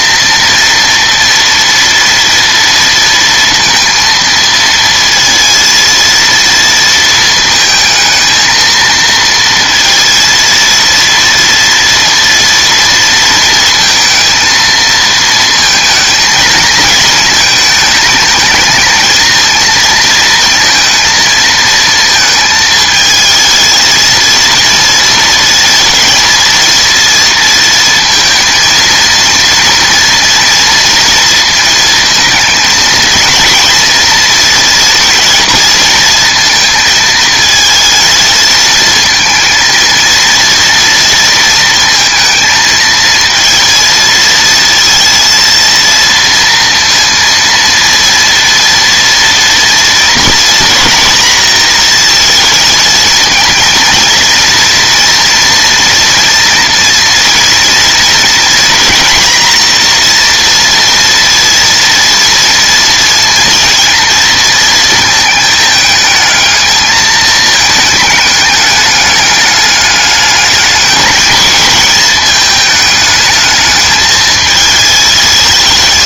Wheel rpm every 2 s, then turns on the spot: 230, 230, 230, 230, 230, 230, 230, 220, 220, 220, 230, 220, 230, 230, 230, 230, 220, 230, 230, 220, 230, 230, 230, 230, 230, 240, 220, 230, 230, 240, 240, 230, 230, 220, 210, 210, 210, 220.
none